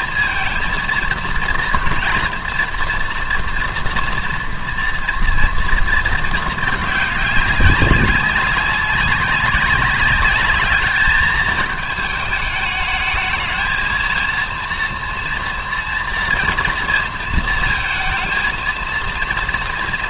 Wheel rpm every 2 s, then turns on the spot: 230, 230, 230, 220, 200, 210, 210, 230, 230, 230.
none